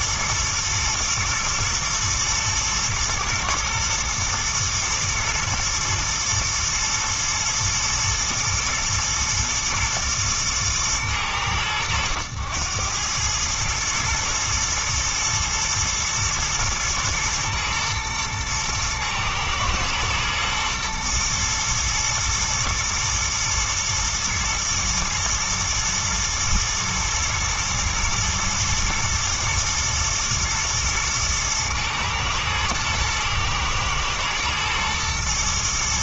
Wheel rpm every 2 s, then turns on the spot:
110, 110, 110, 120, 110, 110, 100, 110, 110, 110, 120, 120, 110, 120, 110, 110, 110, 120.
none